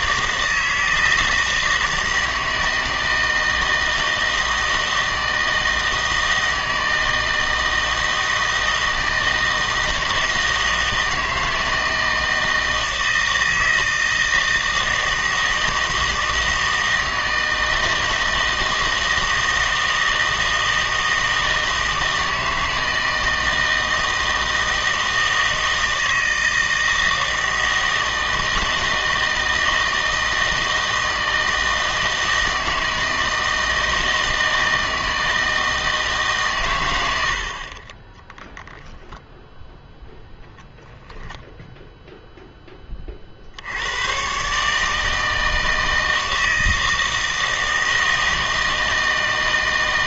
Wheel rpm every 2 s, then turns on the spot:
160, 160, 160, 160, 160, 160, 160, 160, 160, 160, 160, 160, 160, 160, 160, 160, 160, 160, 110, 0, 0, 20, 150, 160, 160.
none